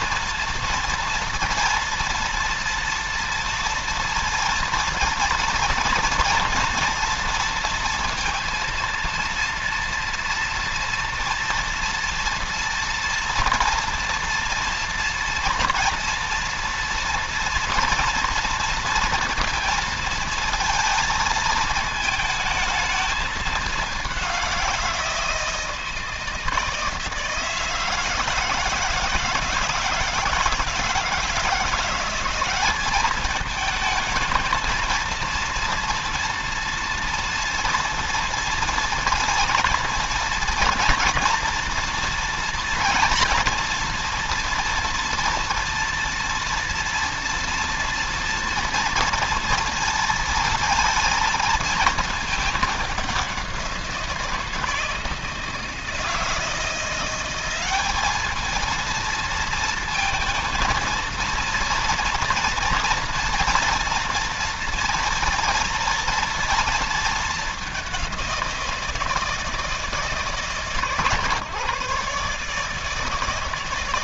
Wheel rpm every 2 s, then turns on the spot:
230, 230, 230, 230, 230, 230, 240, 240, 230, 230, 220, 220, 180, 160, 160, 160, 200, 230, 240, 230, 230, 240, 230, 230, 230, 230, 200, 160, 170, 220, 230, 230, 230, 230, 170, 140, 150.
none